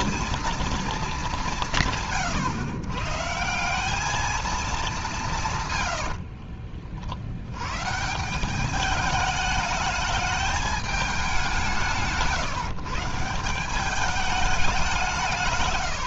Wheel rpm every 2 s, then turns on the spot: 230, 140, 210, 60, 180, 210, 160, 200.
6-8